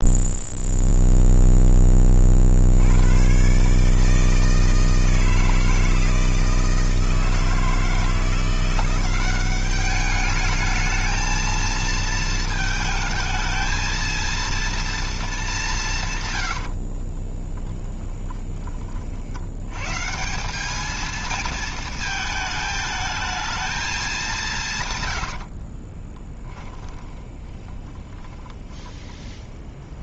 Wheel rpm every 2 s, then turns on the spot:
0, 90, 160, 160, 180, 220, 220, 230, 40, 40, 220, 220, 130, 20, 20.
16-18 24-30